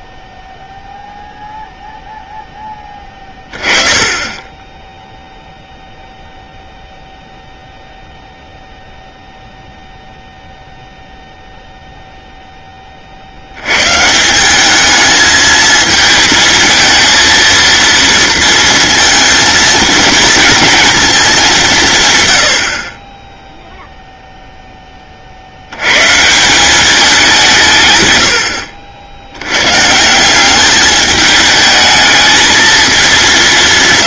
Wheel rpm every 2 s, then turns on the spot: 0, 10, 10, 0, 0, 0, 100, 220, 230, 230, 170, 0, 70, 160, 120, 210, 180.
4-6